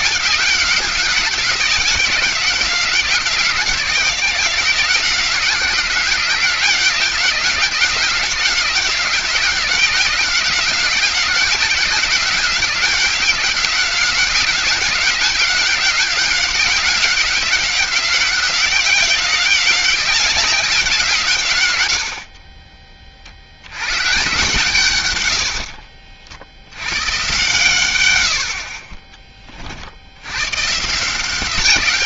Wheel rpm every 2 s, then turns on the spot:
190, 190, 180, 190, 190, 180, 190, 190, 200, 190, 190, 30, 140, 90, 40, 130.
none